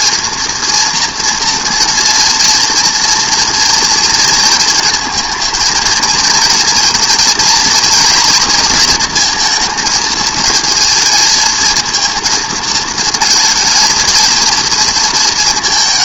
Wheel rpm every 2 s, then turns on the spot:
240, 230, 230, 230, 230, 220, 230, 230.
none